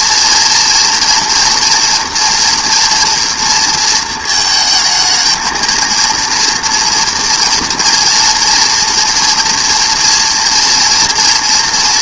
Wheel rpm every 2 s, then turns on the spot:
230, 230, 220, 230, 240, 230.
none